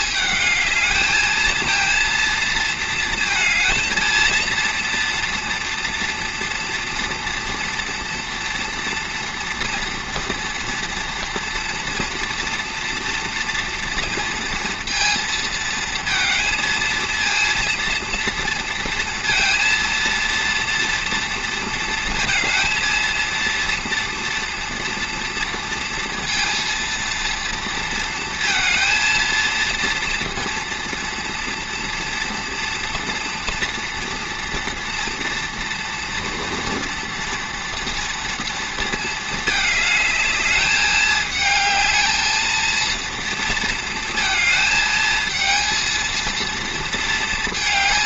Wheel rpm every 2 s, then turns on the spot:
220, 230, 230, 230, 240, 230, 230, 230, 230, 230, 240, 230, 230, 230, 230, 230, 230, 230, 230, 230, 210, 230, 220, 230.
none